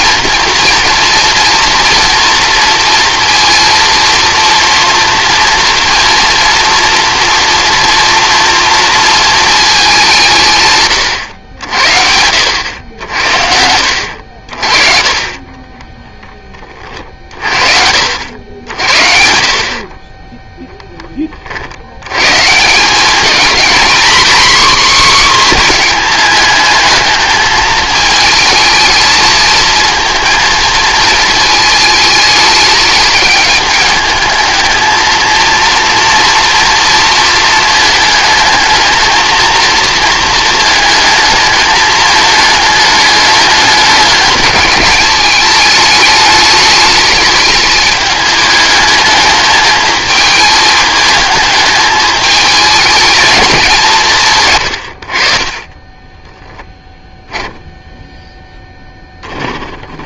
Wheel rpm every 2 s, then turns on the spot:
230, 230, 230, 230, 230, 130, 80, 40, 30, 60, 10, 190, 260, 220, 220, 230, 210, 220, 230, 220, 220, 210, 210, 220, 210, 220, 210, 100, 10, 10.
54-58